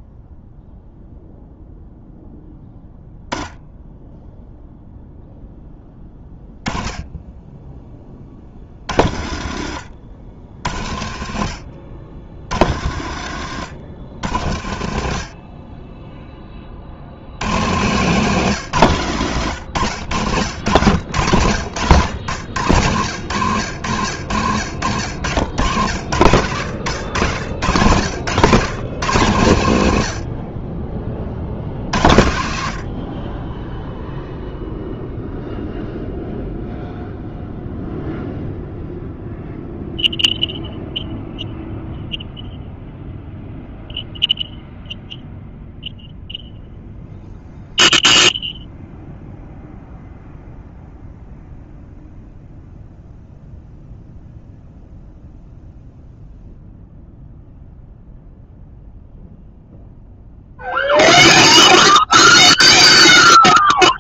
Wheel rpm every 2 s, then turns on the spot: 0, 0, 0, 10, 60, 60, 70, 70, 40, 180, 110, 110, 100, 120, 170, 40, 90, 0, 0, 0, 0, 0, 0, 0, 0, 0, 0, 0, 0, 0, 0, 0.
none